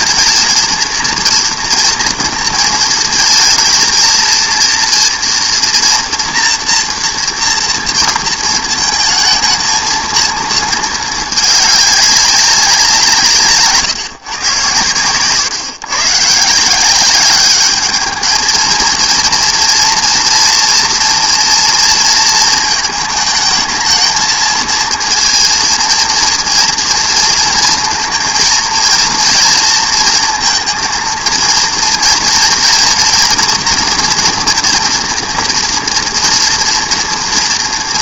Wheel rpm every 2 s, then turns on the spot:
230, 230, 230, 230, 220, 220, 180, 120, 160, 230, 230, 220, 230, 230, 230, 220, 230, 240, 230.
none